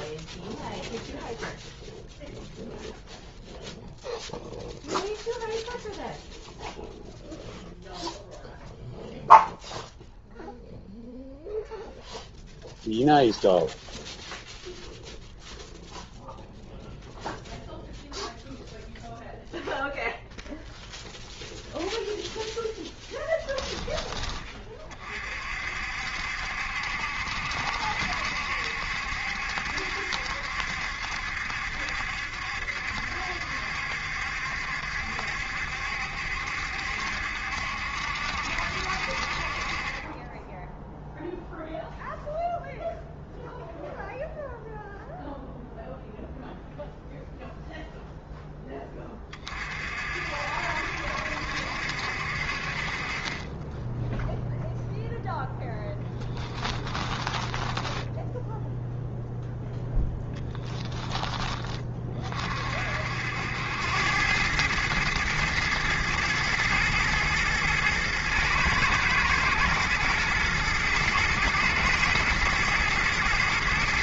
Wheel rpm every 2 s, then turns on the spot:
0, 0, 0, 0, 0, 0, 0, 0, 0, 0, 0, 10, 30, 70, 70, 70, 70, 70, 70, 60, 0, 0, 0, 0, 10, 60, 40, 0, 10, 0, 10, 50, 110, 110, 110, 110, 110.
56-58